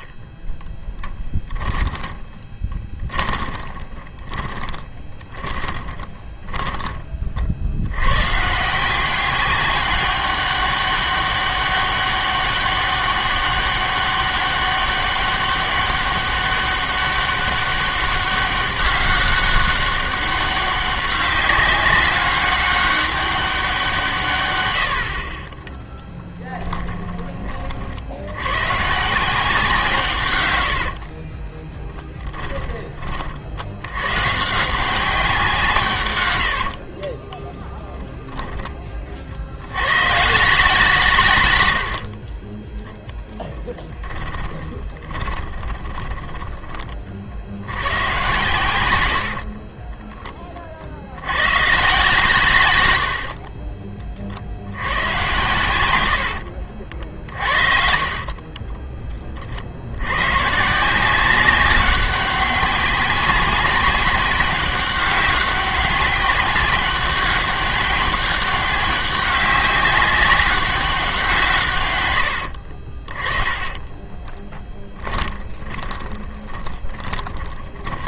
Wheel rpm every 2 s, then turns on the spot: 10, 20, 20, 20, 160, 200, 200, 200, 200, 200, 200, 200, 110, 10, 110, 80, 20, 160, 70, 20, 160, 20, 20, 20, 110, 30, 120, 60, 60, 30, 140, 190, 190, 190, 190, 190, 60, 20, 20.
2-8 32-34 42-46 56-60 72-78